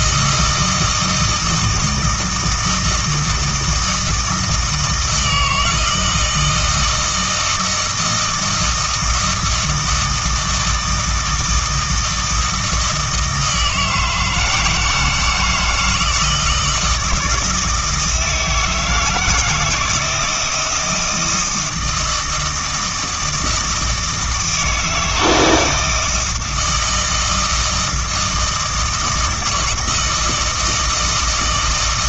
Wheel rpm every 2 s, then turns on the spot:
160, 160, 160, 160, 160, 160, 160, 170, 160, 160, 160, 160, 160, 160, 160, 160.
none